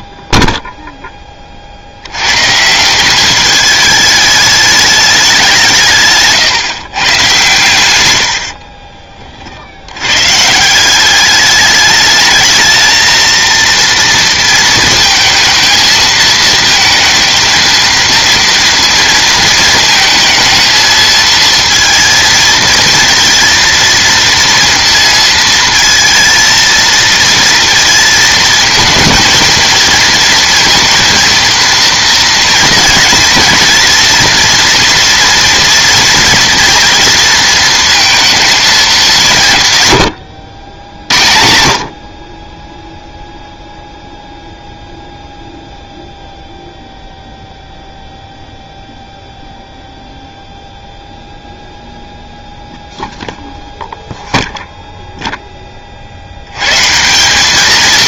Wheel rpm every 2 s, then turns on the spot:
0, 150, 210, 150, 50, 160, 220, 230, 220, 230, 220, 230, 230, 220, 220, 230, 230, 240, 240, 220, 90, 20, 0, 0, 0, 0, 0, 0, 110.
8-10